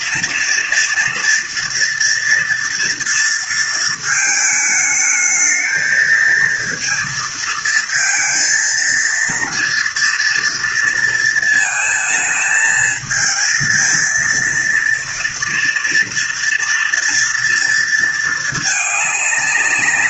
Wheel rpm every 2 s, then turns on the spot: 230, 230, 220, 230, 230, 230, 220, 230, 240, 210.
none